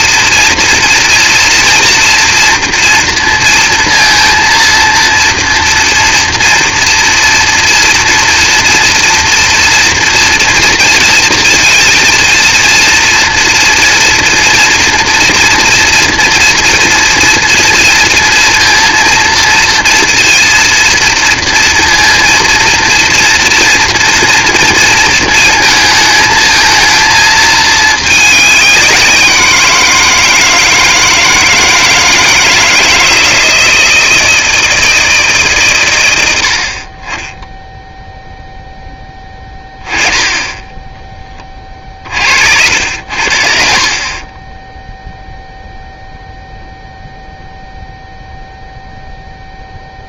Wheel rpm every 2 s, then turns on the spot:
230, 230, 230, 230, 230, 230, 230, 240, 230, 230, 230, 230, 230, 220, 200, 160, 160, 160, 60, 10, 10, 60, 10, 0, 0.
none